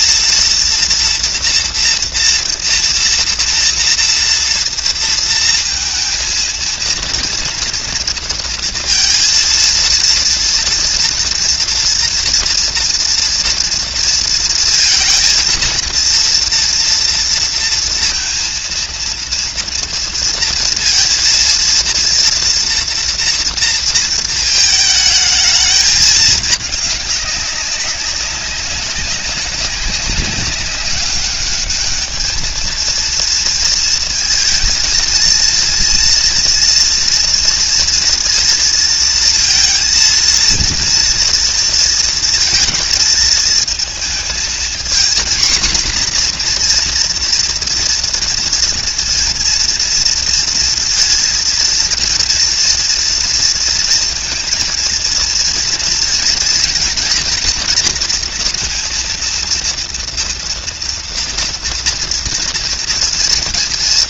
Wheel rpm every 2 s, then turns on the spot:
230, 240, 230, 230, 230, 230, 230, 230, 230, 230, 230, 230, 220, 210, 200, 200, 220, 230, 240, 230, 230, 230, 230, 240, 230, 230, 230, 230, 240, 230, 240, 240.
none